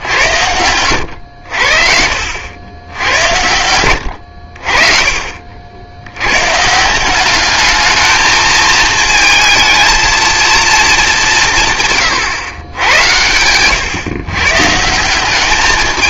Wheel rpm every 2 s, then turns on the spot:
90, 90, 50, 160, 220, 220, 120, 150.
none